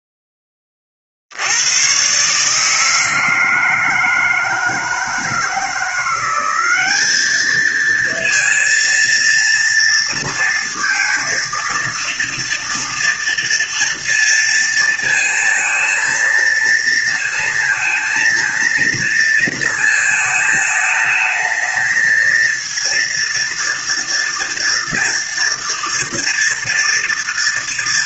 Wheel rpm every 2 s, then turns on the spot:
10, 150, 160, 190, 230, 230, 230, 230, 230, 230, 220, 230, 230, 230.
none